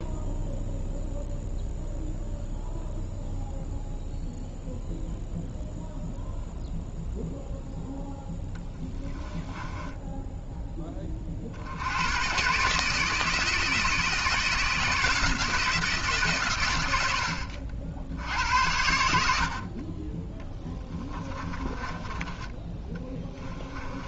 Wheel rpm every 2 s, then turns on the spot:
0, 0, 0, 0, 10, 10, 130, 160, 120, 80, 10, 20.
8-10 20-22